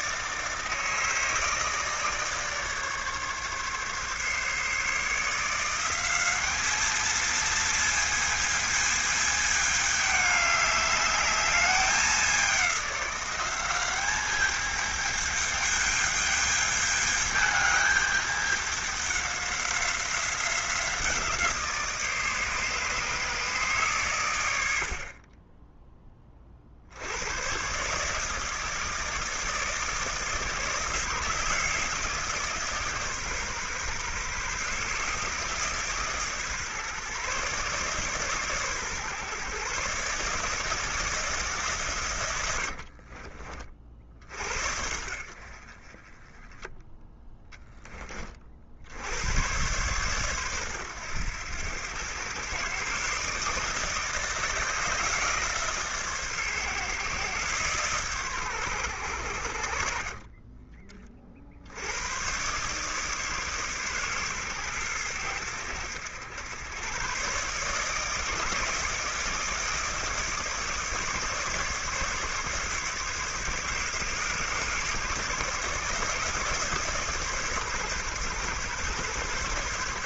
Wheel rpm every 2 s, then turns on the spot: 160, 150, 150, 210, 220, 210, 190, 210, 210, 200, 170, 150, 70, 70, 160, 150, 150, 140, 140, 130, 150, 50, 70, 10, 70, 110, 130, 150, 140, 100, 20, 130, 110, 120, 160, 150, 140, 140, 140, 130.
42-44 46-48